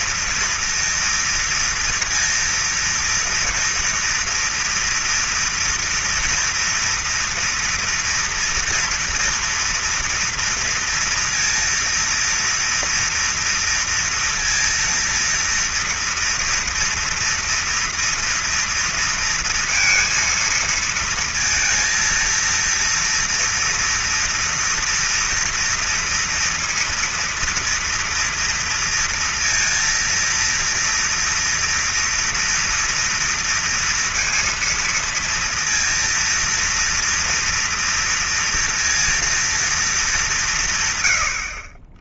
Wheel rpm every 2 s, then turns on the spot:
230, 230, 230, 230, 230, 230, 230, 230, 230, 230, 230, 230, 230, 230, 230, 230, 230, 230, 230, 230, 120.
none